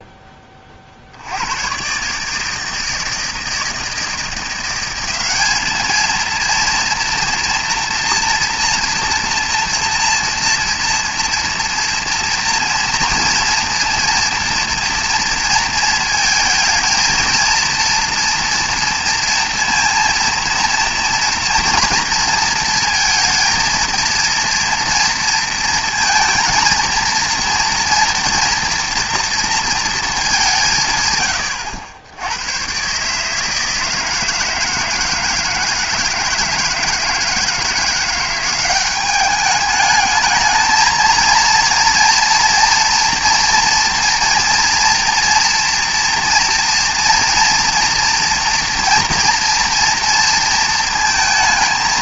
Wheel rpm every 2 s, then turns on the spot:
50, 160, 190, 230, 240, 230, 230, 230, 230, 230, 230, 230, 230, 230, 230, 130, 140, 160, 160, 200, 230, 240, 240, 230, 240, 230.
none